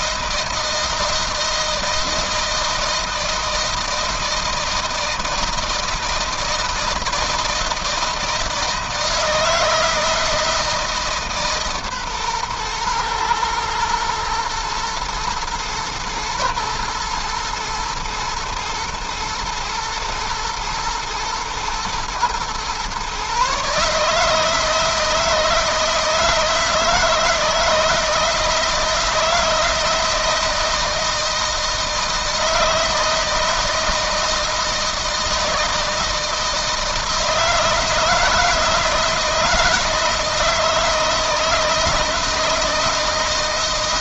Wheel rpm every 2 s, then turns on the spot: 160, 160, 160, 160, 160, 160, 120, 120, 110, 120, 120, 120, 160, 160, 160, 160, 160, 160, 160, 160, 160, 160.
none